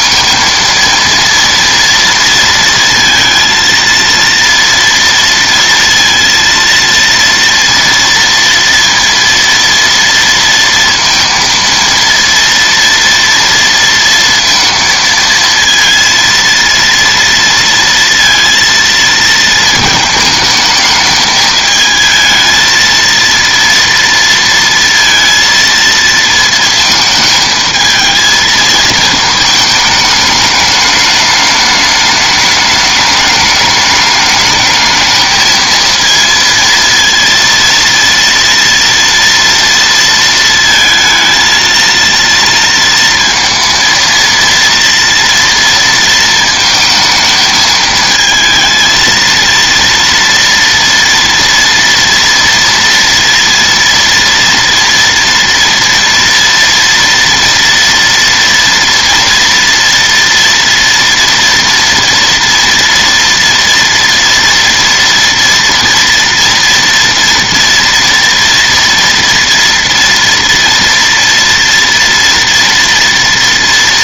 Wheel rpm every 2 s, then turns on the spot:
230, 230, 230, 230, 230, 230, 230, 230, 230, 230, 220, 230, 230, 220, 220, 210, 210, 220, 230, 230, 230, 230, 230, 220, 230, 230, 230, 230, 230, 230, 230, 230, 230, 230, 230, 230, 230.
none